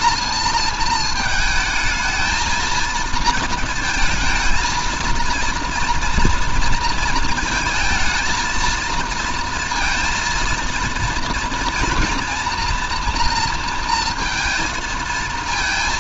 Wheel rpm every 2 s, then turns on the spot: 230, 220, 230, 230, 220, 230, 230, 230.
none